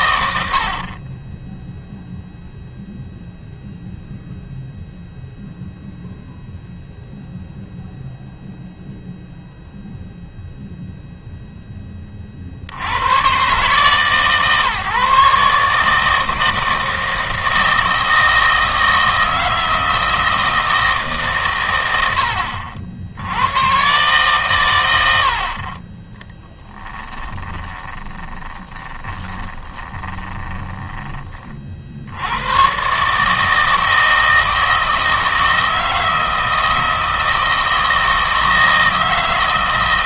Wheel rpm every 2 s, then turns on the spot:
70, 0, 0, 0, 0, 0, 60, 150, 160, 160, 160, 60, 120, 10, 20, 10, 120, 160, 160, 160.
26-32